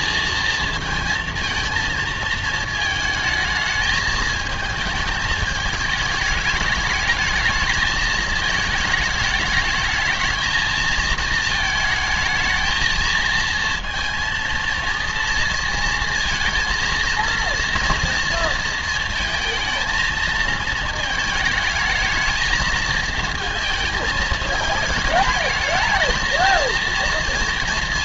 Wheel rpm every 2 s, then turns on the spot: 230, 220, 220, 210, 220, 220, 220, 230, 230, 230, 220, 220, 220, 230.
none